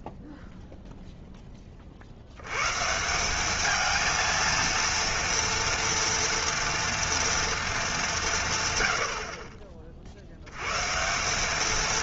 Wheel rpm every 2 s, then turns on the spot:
0, 130, 230, 230, 130, 110.
none